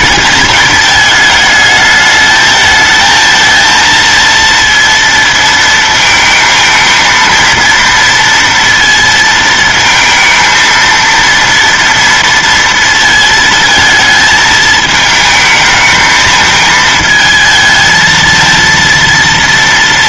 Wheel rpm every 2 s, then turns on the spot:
220, 220, 230, 220, 230, 230, 230, 220, 220, 230.
none